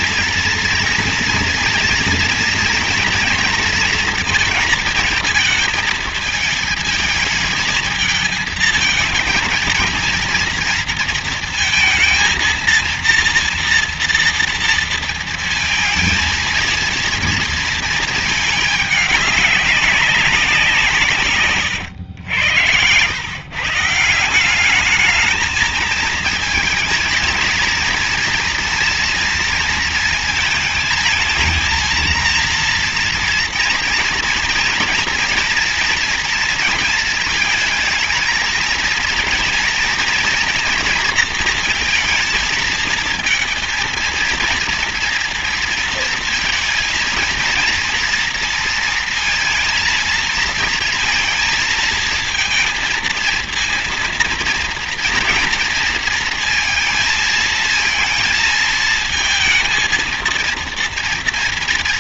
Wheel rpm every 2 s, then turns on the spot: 230, 240, 230, 220, 220, 230, 230, 230, 230, 210, 170, 110, 200, 230, 230, 230, 230, 230, 230, 230, 230, 220, 230, 230, 230, 230, 230, 230, 230, 220, 230.
none